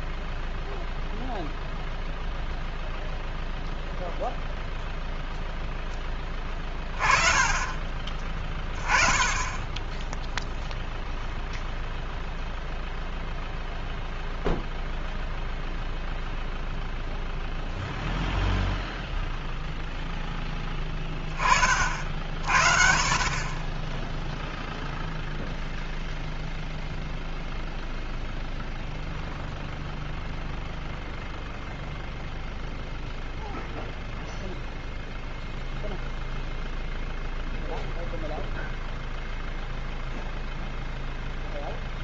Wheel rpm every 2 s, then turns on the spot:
0, 0, 0, 10, 20, 0, 0, 0, 0, 0, 10, 50, 0, 0, 0, 0, 0, 0, 0, 0, 0.
none